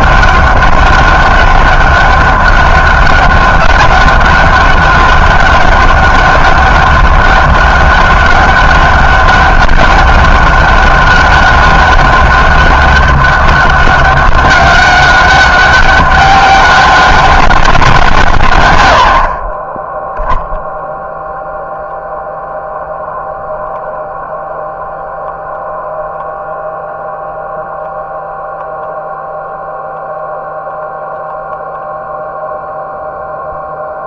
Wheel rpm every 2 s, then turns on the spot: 200, 200, 200, 200, 200, 200, 200, 200, 200, 110, 10, 0, 0, 0, 0, 0, 0.
none